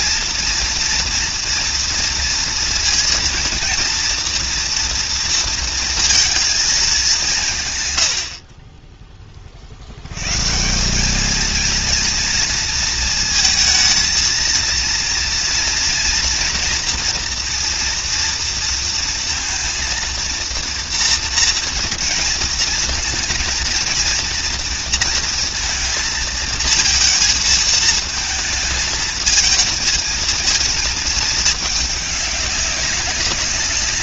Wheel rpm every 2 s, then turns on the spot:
230, 230, 240, 210, 30, 190, 230, 230, 230, 230, 230, 230, 230, 230, 220, 220, 190.
none